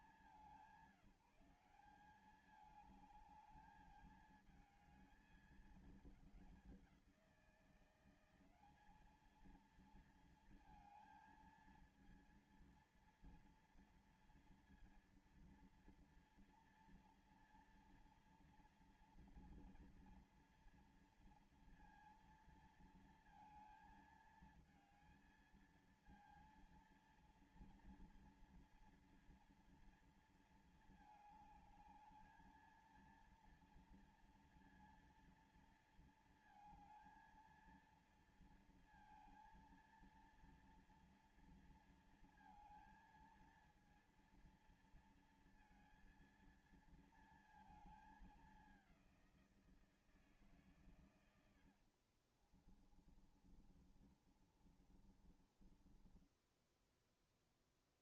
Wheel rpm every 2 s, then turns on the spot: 180, 210, 220, 190, 200, 220, 230, 230, 230, 240, 230, 230, 220, 230, 230, 220, 220, 230, 220, 230, 230, 220, 230, 230, 190, 120, 30, 30, 10.
50-56